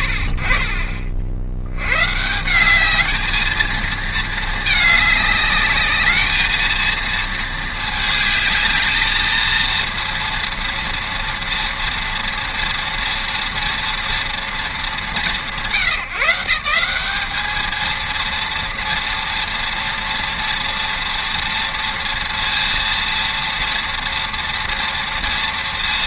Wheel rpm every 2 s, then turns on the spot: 50, 200, 210, 230, 220, 230, 230, 230, 190, 230, 230, 230, 230.
none